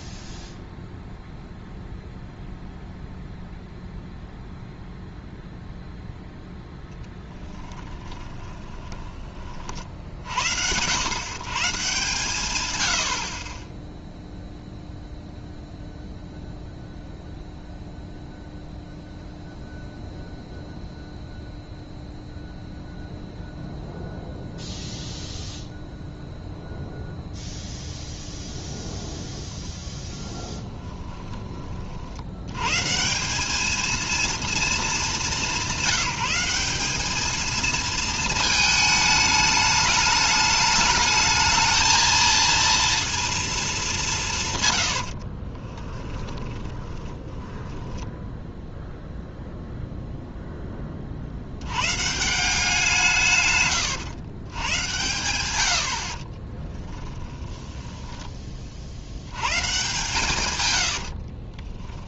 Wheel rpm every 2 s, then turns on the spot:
0, 0, 0, 0, 10, 70, 120, 0, 0, 0, 0, 0, 0, 0, 0, 10, 120, 230, 190, 220, 210, 230, 120, 10, 0, 10, 170, 110, 20, 30, 110.
8-10 30-32 46-48 56-58 60-62